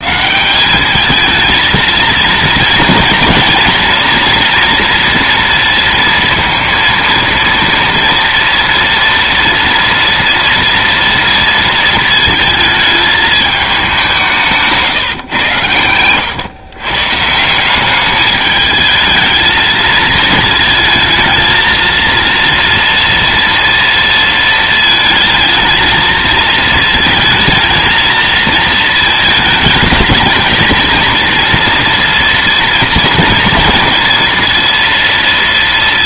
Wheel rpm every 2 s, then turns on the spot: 170, 230, 240, 230, 230, 230, 220, 160, 110, 210, 220, 230, 230, 230, 220, 220, 230, 230.
none